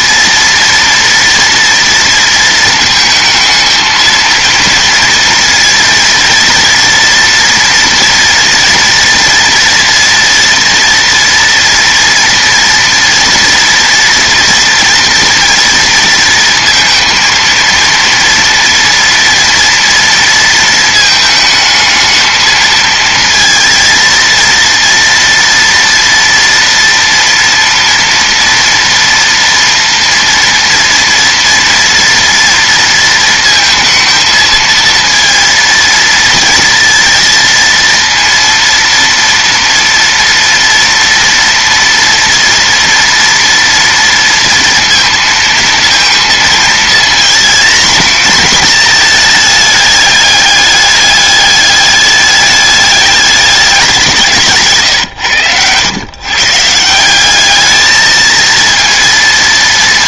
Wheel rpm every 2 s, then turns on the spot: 240, 220, 230, 230, 230, 230, 230, 240, 230, 230, 220, 230, 230, 230, 230, 230, 230, 230, 230, 230, 230, 230, 230, 230, 220, 210, 210, 120, 180, 230.
none